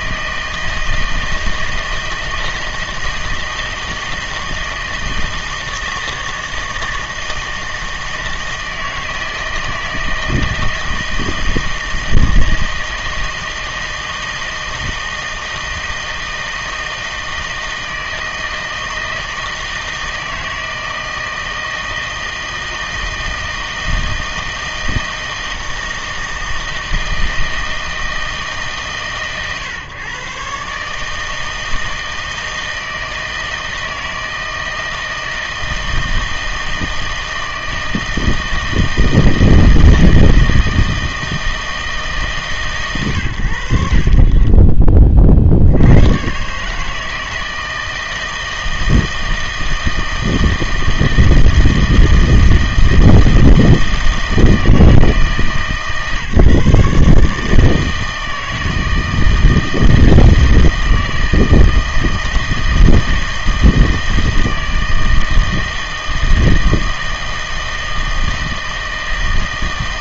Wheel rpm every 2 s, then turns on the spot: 160, 160, 160, 160, 160, 160, 160, 160, 160, 160, 160, 160, 160, 160, 140, 150, 160, 160, 160, 160, 160, 140, 30, 140, 160, 160, 160, 160, 140, 160, 160, 160, 160, 160, 160.
none